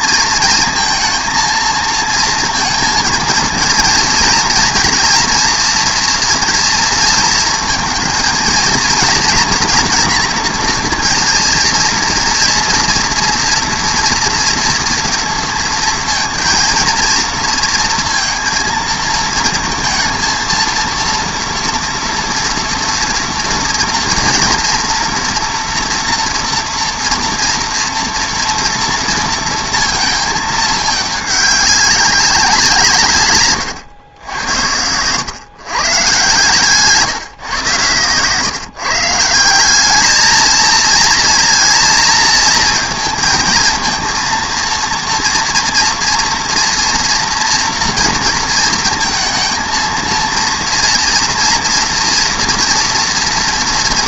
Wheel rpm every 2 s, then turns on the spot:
230, 230, 240, 230, 230, 230, 230, 230, 230, 230, 230, 240, 230, 230, 230, 220, 180, 90, 150, 150, 220, 220, 230, 230, 220, 230, 240.
none